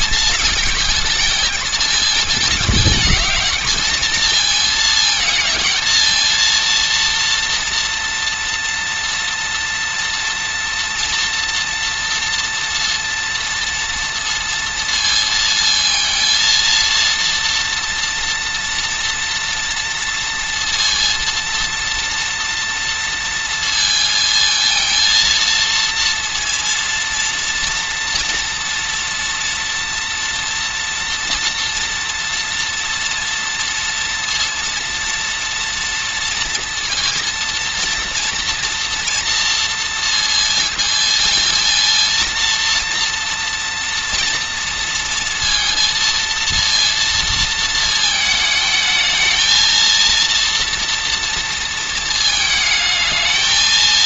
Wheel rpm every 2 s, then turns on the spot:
230, 220, 220, 230, 230, 230, 230, 230, 230, 240, 230, 230, 220, 230, 230, 230, 230, 230, 230, 230, 230, 230, 230, 230, 220, 230, 220.
none